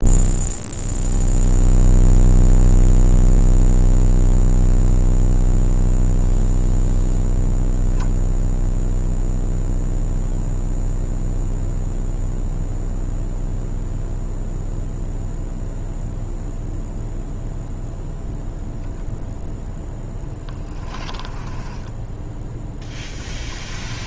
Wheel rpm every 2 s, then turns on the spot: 0, 0, 0, 0, 0, 0, 0, 0, 0, 0, 20, 10.
20-22